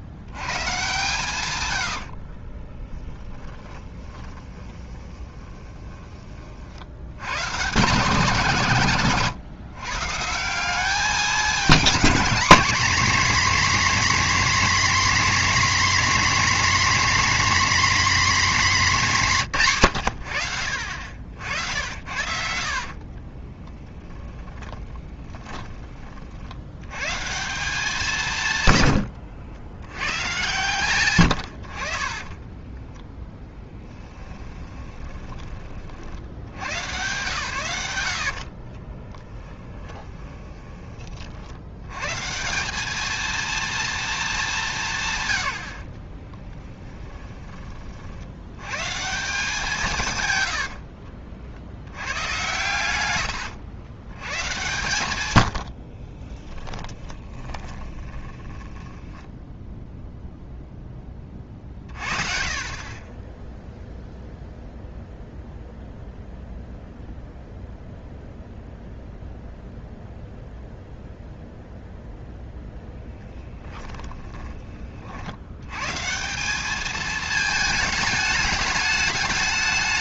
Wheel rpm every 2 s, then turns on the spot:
130, 20, 20, 60, 150, 190, 250, 270, 270, 240, 70, 50, 10, 100, 110, 130, 10, 20, 110, 50, 30, 190, 160, 30, 130, 70, 120, 120, 10, 10, 10, 40, 0, 0, 0, 0, 10, 30, 210, 210.
2-6 22-26 28-30 32-36 38-40 46-48 50-52 56-60 72-74